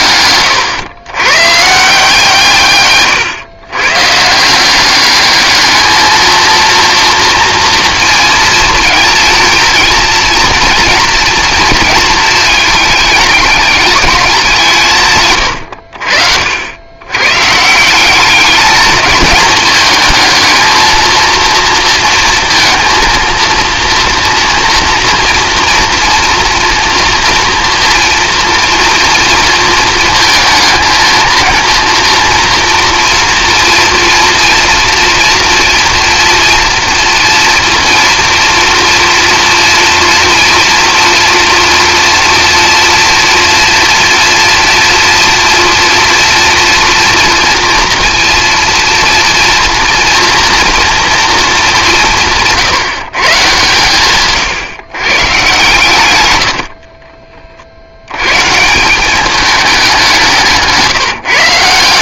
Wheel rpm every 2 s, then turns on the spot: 110, 130, 180, 230, 230, 230, 220, 150, 100, 210, 220, 230, 230, 240, 230, 230, 230, 230, 230, 240, 230, 230, 230, 240, 230, 230, 160, 140, 50, 170, 160.
56-58